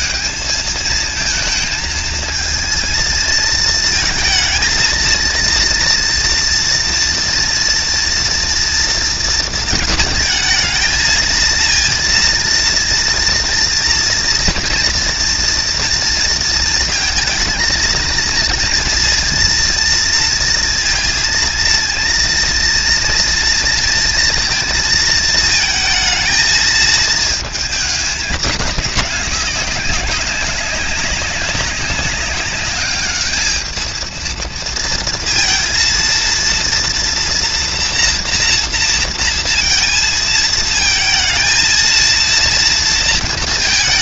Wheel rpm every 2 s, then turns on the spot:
220, 230, 230, 230, 230, 220, 230, 230, 220, 230, 230, 230, 230, 220, 200, 200, 210, 230, 230, 230, 230, 230.
none